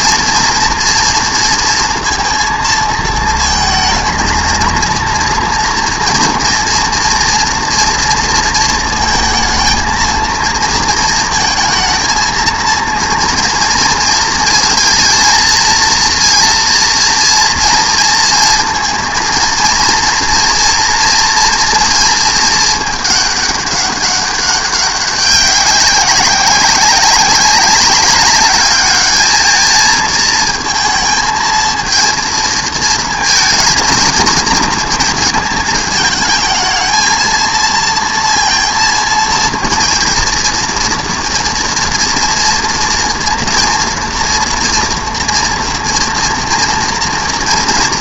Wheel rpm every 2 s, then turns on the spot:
230, 230, 230, 240, 230, 230, 230, 230, 230, 230, 230, 220, 200, 190, 210, 230, 220, 230, 220, 230, 230, 230, 230, 230.
none